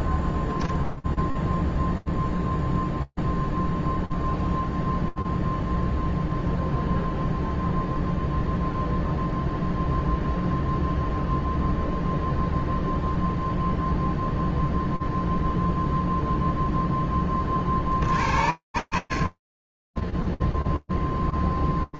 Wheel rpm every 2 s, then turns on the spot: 0, 0, 0, 0, 0, 0, 0, 0, 0, 70, 10.
none